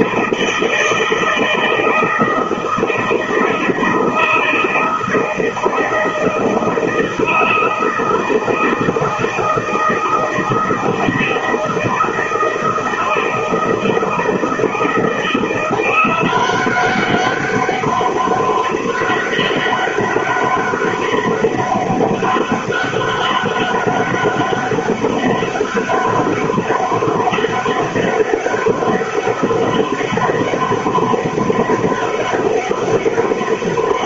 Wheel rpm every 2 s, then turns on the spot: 160, 160, 160, 160, 160, 160, 160, 170, 190, 200, 200, 200, 200, 200, 200, 200, 200.
none